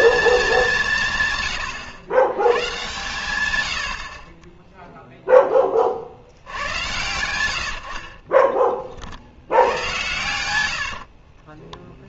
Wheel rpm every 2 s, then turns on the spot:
100, 90, 10, 90, 90, 20.
10-12